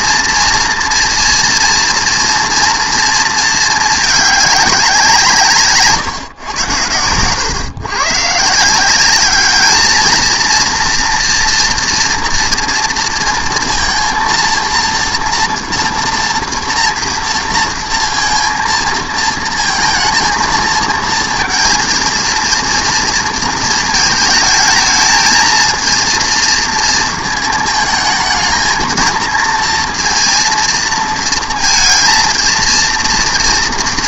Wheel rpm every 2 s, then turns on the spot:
230, 230, 190, 100, 160, 230, 230, 230, 230, 230, 230, 230, 220, 230, 230, 230, 230.
none